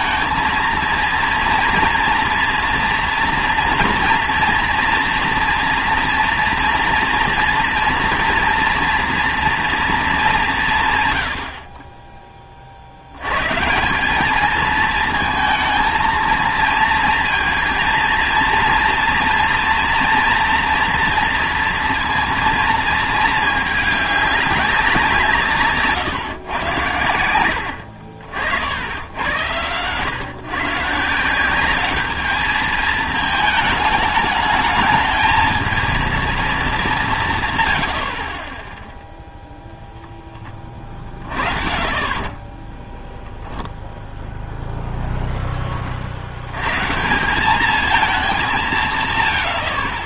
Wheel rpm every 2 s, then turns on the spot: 220, 230, 230, 240, 240, 180, 30, 220, 220, 230, 230, 230, 200, 120, 70, 140, 220, 210, 220, 10, 20, 20, 0, 100, 190.
42-44